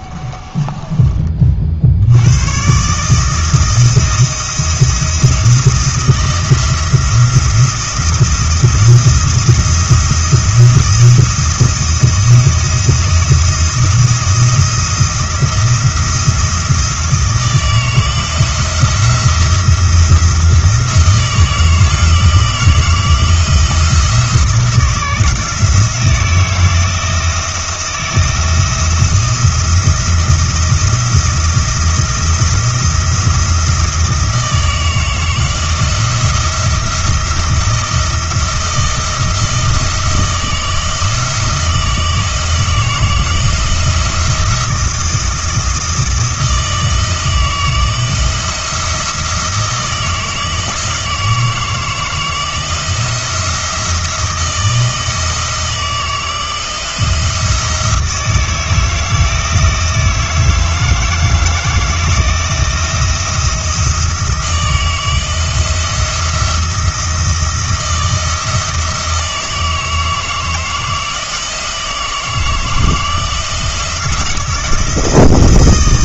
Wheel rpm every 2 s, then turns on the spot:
20, 130, 170, 170, 170, 170, 170, 170, 170, 170, 170, 160, 170, 160, 160, 170, 170, 160, 170, 170, 170, 160, 170, 160, 170, 160, 160, 160, 160, 160, 160, 170, 160, 170, 160, 160, 160, 170.
0-2